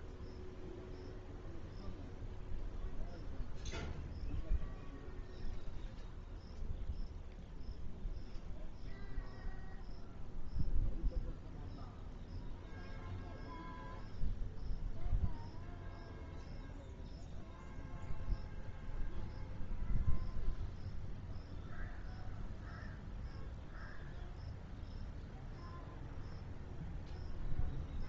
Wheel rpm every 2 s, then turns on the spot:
0, 0, 0, 0, 0, 0, 0, 0, 0, 0, 0, 0, 0, 0.
none